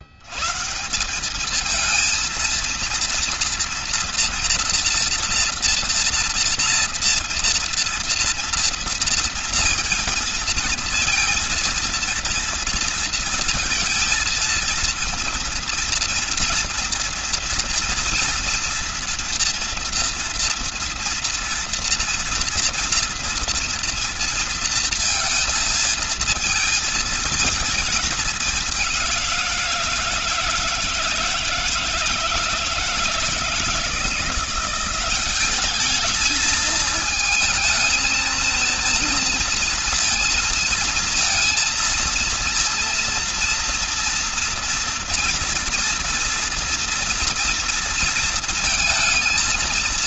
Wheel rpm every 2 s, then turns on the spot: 160, 230, 230, 230, 230, 230, 230, 230, 230, 230, 230, 230, 230, 220, 190, 160, 170, 180, 220, 230, 230, 230, 240, 230, 230.
none